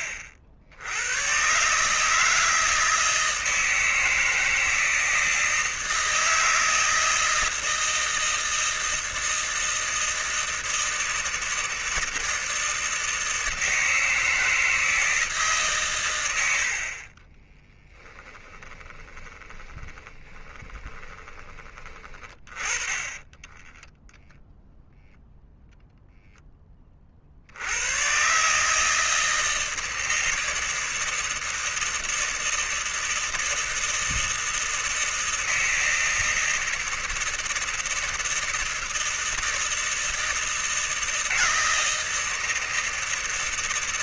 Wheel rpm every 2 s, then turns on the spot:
80, 160, 160, 160, 160, 160, 160, 160, 70, 20, 20, 20, 0, 10, 150, 160, 160, 160, 160, 160, 160, 160.
16-22